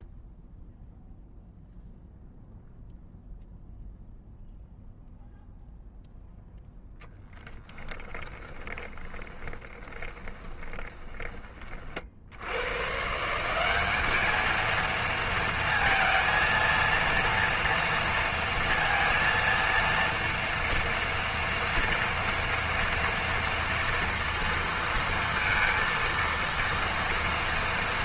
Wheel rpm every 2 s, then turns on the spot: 0, 0, 0, 0, 20, 20, 100, 220, 230, 230, 230, 230, 230, 230.
8-12